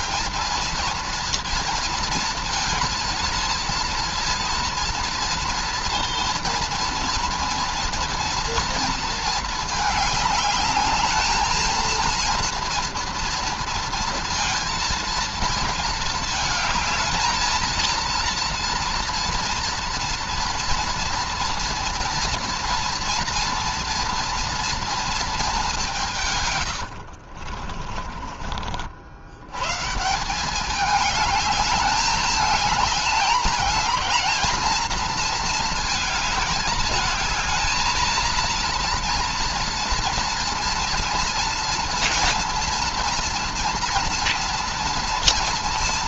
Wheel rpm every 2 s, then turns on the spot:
220, 230, 230, 230, 230, 210, 230, 230, 220, 230, 230, 230, 240, 130, 40, 190, 210, 220, 220, 230, 240, 230, 230.
26-28